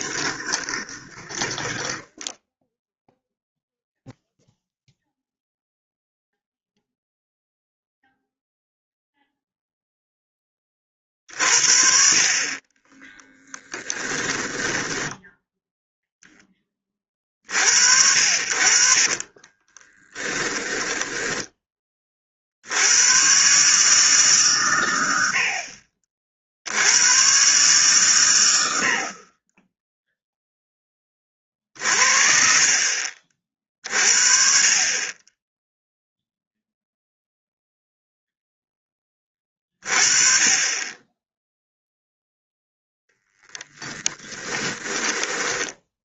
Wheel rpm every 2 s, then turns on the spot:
20, 0, 0, 0, 0, 20, 40, 10, 20, 60, 10, 70, 120, 70, 90, 10, 40, 40, 0, 10, 30, 10, 20.
0-2 14-16 20-22 42-46